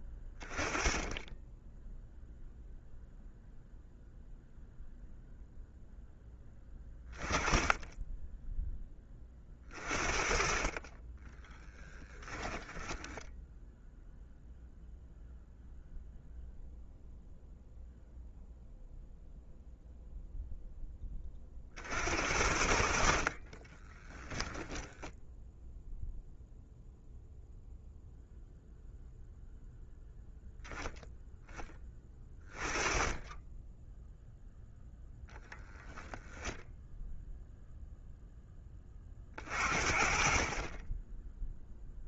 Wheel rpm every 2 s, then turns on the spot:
20, 0, 0, 20, 20, 30, 10, 0, 0, 0, 10, 60, 0, 0, 0, 0, 20, 0, 0, 20, 20.
12-14